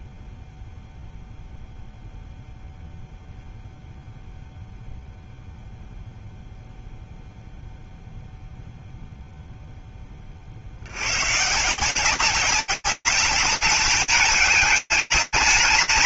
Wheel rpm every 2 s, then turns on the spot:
0, 0, 0, 0, 0, 150, 200, 210.
none